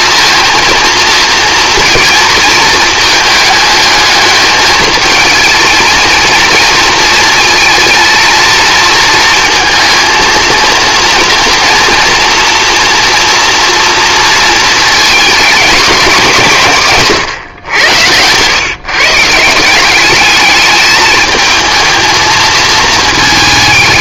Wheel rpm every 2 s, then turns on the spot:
230, 220, 220, 230, 230, 230, 230, 220, 140, 140, 210, 220.
none